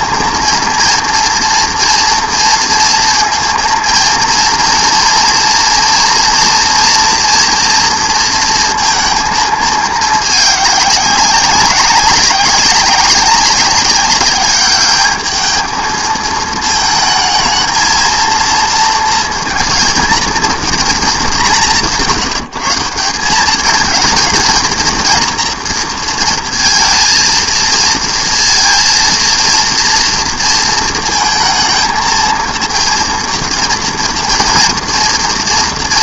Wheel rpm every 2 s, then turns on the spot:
230, 230, 230, 230, 230, 200, 200, 210, 220, 230, 220, 170, 230, 230, 230, 230, 230, 230.
none